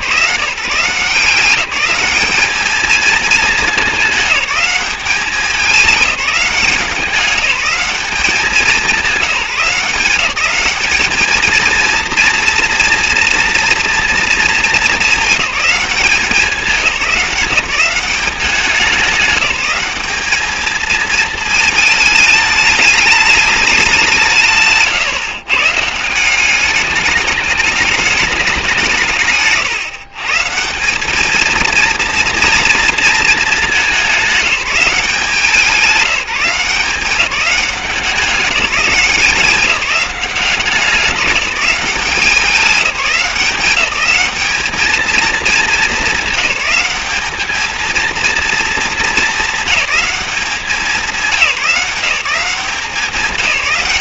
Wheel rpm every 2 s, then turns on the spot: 180, 220, 200, 180, 190, 200, 230, 220, 190, 190, 210, 210, 150, 200, 190, 170, 230, 190, 180, 180, 190, 190, 210, 210, 230, 190, 180.
none